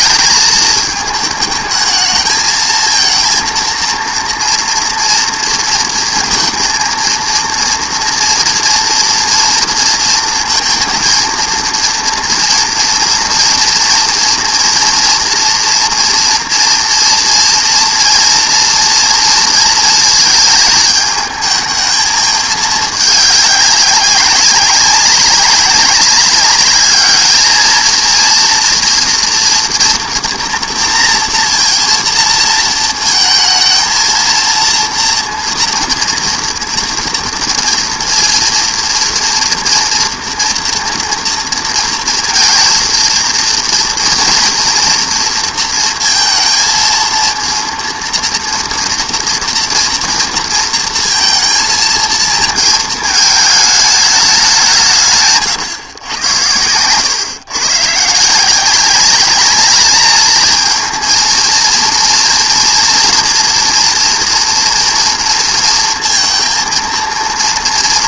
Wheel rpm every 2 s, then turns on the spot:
220, 220, 230, 230, 230, 230, 230, 230, 230, 230, 220, 220, 190, 210, 230, 240, 230, 230, 240, 240, 230, 220, 240, 230, 230, 230, 220, 180, 110, 180, 220, 230, 230, 230.
56-58